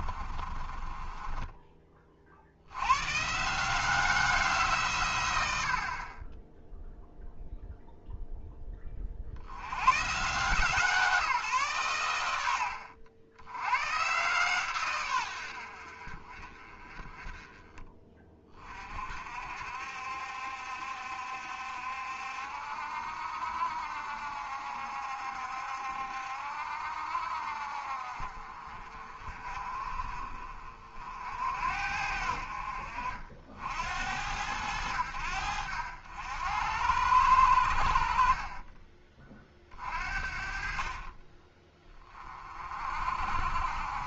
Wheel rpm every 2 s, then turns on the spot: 30, 90, 150, 0, 20, 150, 80, 130, 30, 40, 70, 60, 60, 60, 50, 50, 60, 80, 90, 20, 40, 40.
0-2 12-14 38-42